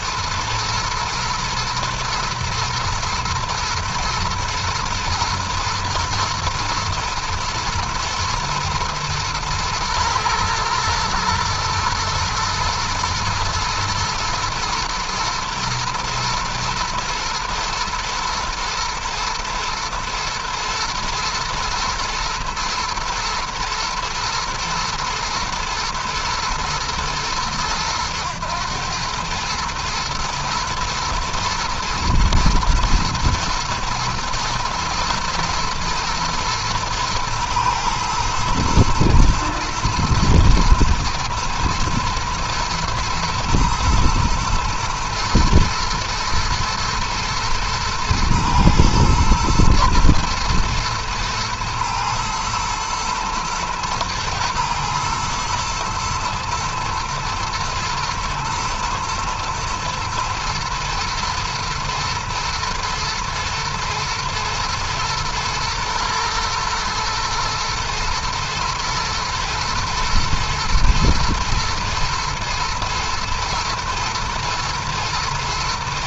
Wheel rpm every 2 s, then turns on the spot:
120, 120, 110, 120, 110, 110, 120, 110, 120, 120, 110, 110, 110, 110, 110, 120, 120, 110, 110, 110, 110, 110, 120, 110, 110, 120, 120, 110, 110, 110, 110, 120, 110, 110, 110, 120, 110, 110.
none